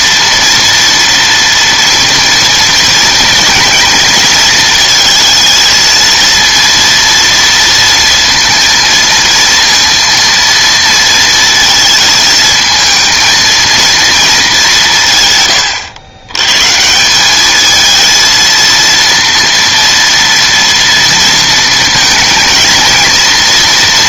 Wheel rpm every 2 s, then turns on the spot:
230, 230, 230, 230, 230, 230, 230, 200, 120, 230, 240, 230.
none